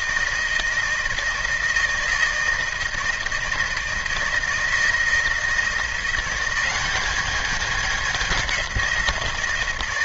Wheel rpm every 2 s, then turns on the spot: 160, 160, 160, 190, 180.
none